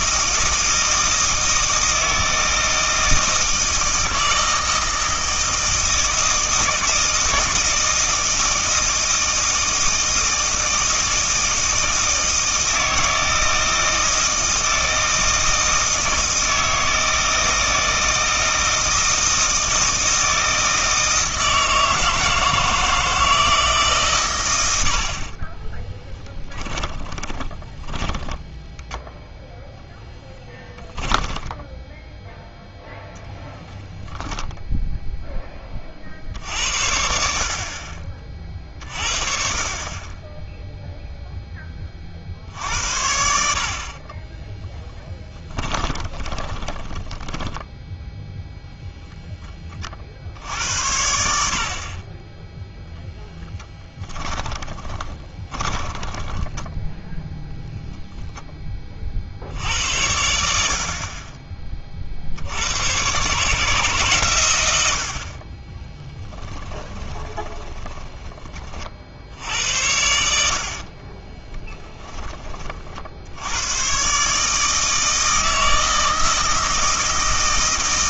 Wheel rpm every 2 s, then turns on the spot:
160, 160, 160, 160, 160, 160, 160, 160, 160, 160, 160, 160, 90, 10, 10, 20, 0, 0, 70, 40, 0, 70, 20, 20, 0, 80, 0, 20, 10, 20, 60, 90, 100, 20, 40, 70, 40, 160, 160.
26-32 44-48 54-58 66-68